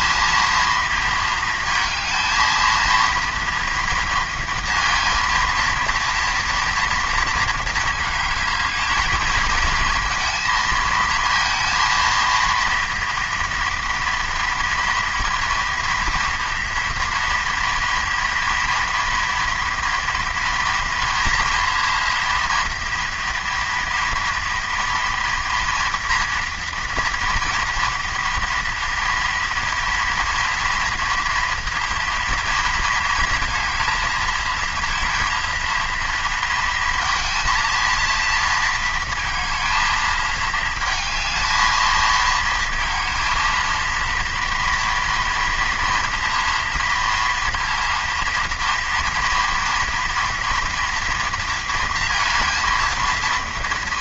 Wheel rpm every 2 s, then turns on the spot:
230, 230, 230, 230, 220, 230, 230, 230, 230, 230, 230, 230, 230, 230, 230, 230, 220, 230, 230, 230, 220, 230, 230, 230, 230, 230, 230.
none